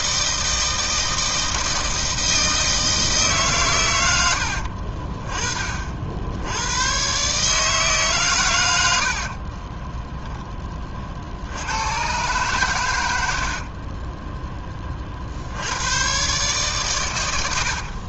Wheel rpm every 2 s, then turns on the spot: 160, 160, 70, 90, 100, 10, 110, 10, 130.
none